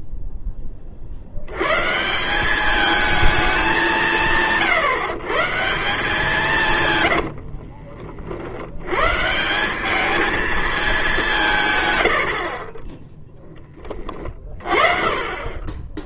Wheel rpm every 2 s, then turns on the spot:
20, 200, 140, 150, 60, 210, 40, 40.
12-14